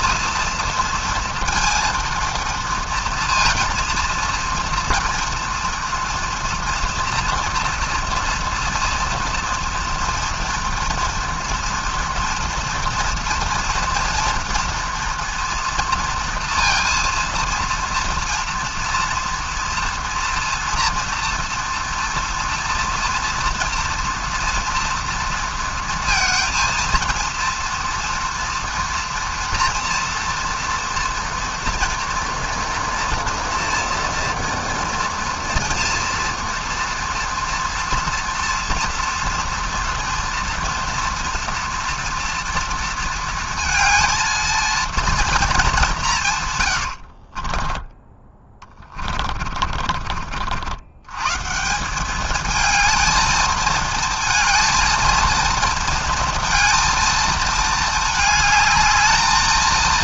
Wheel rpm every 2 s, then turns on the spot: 230, 230, 230, 230, 230, 230, 230, 230, 230, 240, 230, 230, 230, 230, 230, 230, 230, 240, 240, 230, 230, 230, 230, 120, 20, 70, 220, 220, 230, 210.
46-50